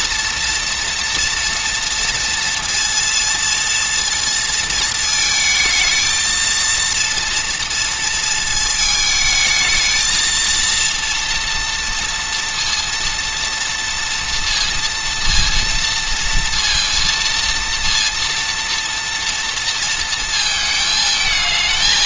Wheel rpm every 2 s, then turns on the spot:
240, 230, 220, 230, 220, 230, 230, 230, 230, 230, 220.
none